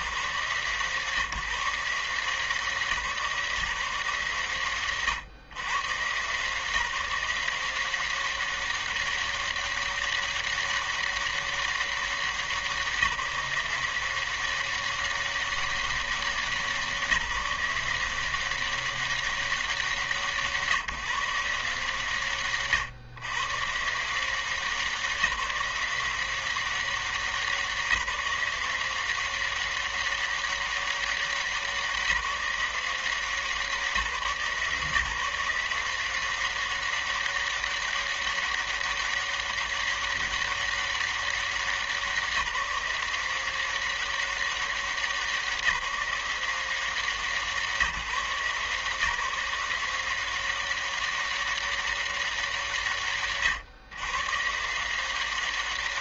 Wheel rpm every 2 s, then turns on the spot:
160, 160, 140, 130, 190, 200, 190, 180, 190, 170, 170, 120, 150, 180, 170, 190, 180, 160, 180, 200, 200, 180, 190, 170, 160, 180, 200, 130.
none